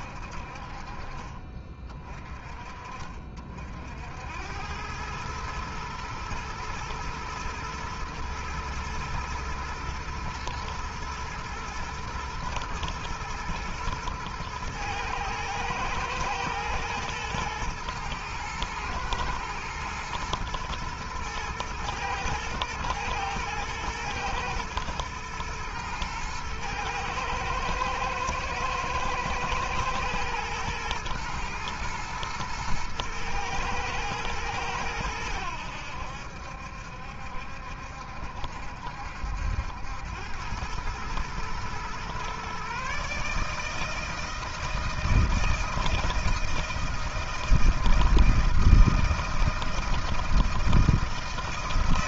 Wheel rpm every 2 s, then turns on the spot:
40, 70, 110, 110, 110, 110, 110, 110, 120, 110, 110, 110, 120, 110, 110, 110, 110, 90, 70, 80, 110, 150, 160, 160, 160, 160.
none